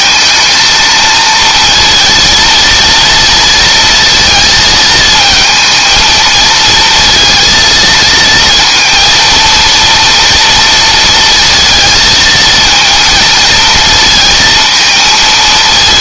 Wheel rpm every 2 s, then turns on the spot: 220, 230, 220, 230, 230, 230, 230, 220.
none